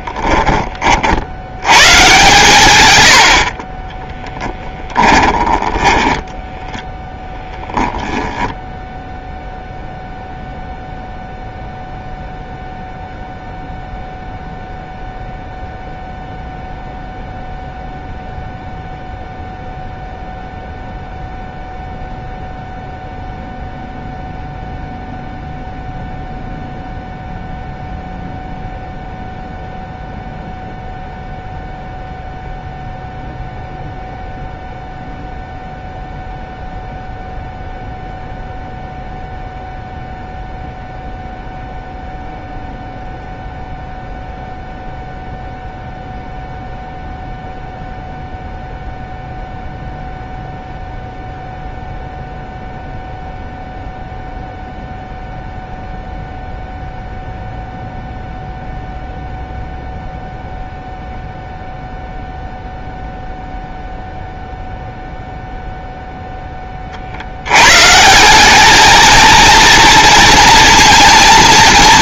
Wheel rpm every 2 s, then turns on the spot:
30, 120, 10, 0, 0, 0, 0, 0, 0, 0, 0, 0, 0, 0, 0, 0, 0, 0, 0, 0, 0, 0, 0, 0, 0, 0, 0, 0, 0, 0, 0, 0, 0, 30, 210, 230.
4-6